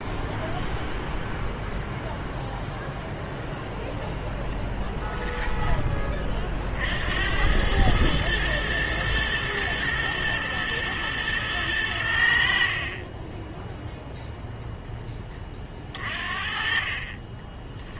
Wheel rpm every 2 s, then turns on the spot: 0, 0, 10, 50, 120, 110, 50, 10, 40.
4-6